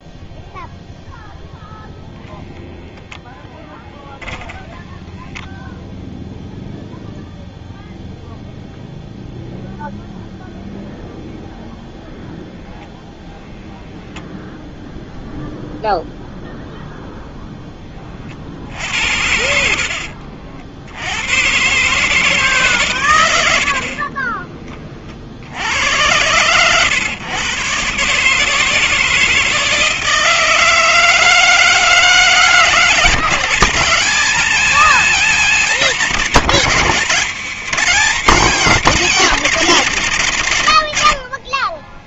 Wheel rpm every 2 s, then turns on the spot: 0, 0, 10, 0, 0, 0, 0, 0, 0, 50, 60, 140, 30, 120, 160, 160, 150, 170, 170, 170, 90.
24-26